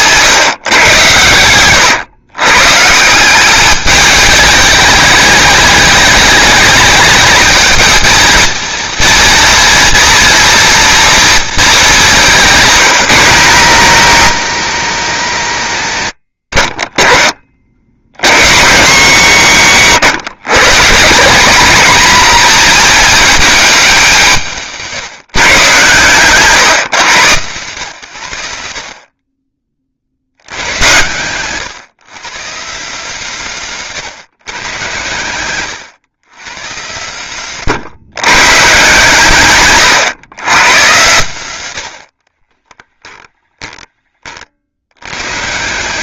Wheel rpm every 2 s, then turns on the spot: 110, 190, 210, 220, 230, 220, 130, 100, 40, 190, 200, 220, 140, 130, 40, 130, 160, 110, 130, 140, 130, 20, 110.
42-44